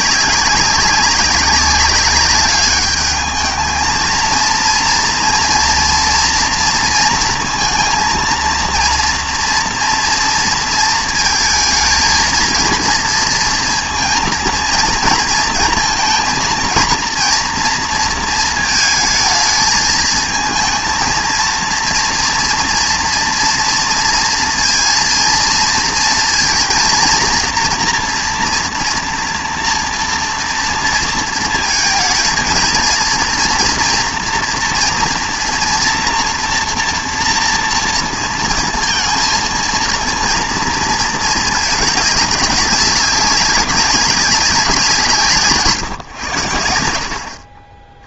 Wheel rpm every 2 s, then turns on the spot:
190, 210, 230, 230, 230, 230, 230, 230, 230, 220, 230, 230, 230, 230, 230, 230, 230, 240, 230, 230, 230, 200, 180, 80.
none